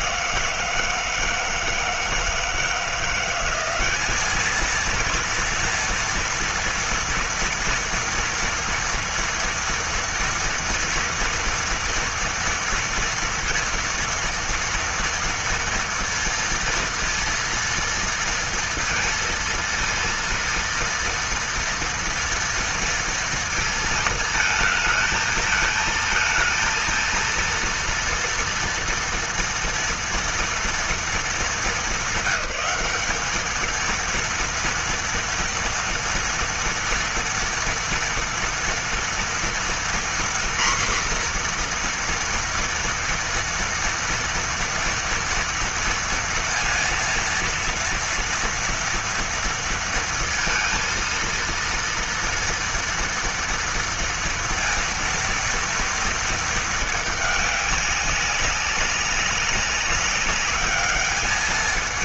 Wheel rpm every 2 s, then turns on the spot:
170, 170, 220, 230, 230, 230, 230, 230, 230, 230, 230, 230, 220, 230, 230, 230, 200, 230, 230, 230, 240, 230, 230, 230, 230, 230, 230, 230, 220, 200, 200.
none